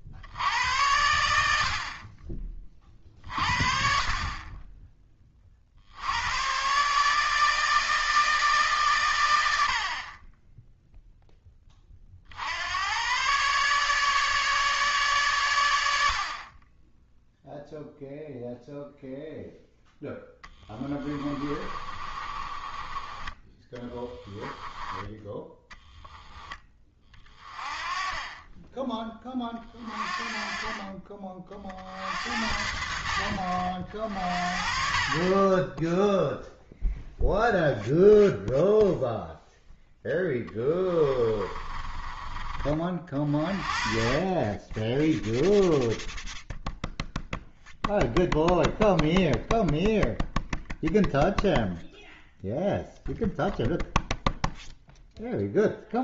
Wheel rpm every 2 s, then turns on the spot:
80, 30, 20, 130, 130, 0, 90, 140, 20, 0, 20, 20, 10, 20, 20, 30, 80, 40, 0, 0, 10, 30, 10, 0, 0, 0, 0, 0.
20-24 40-42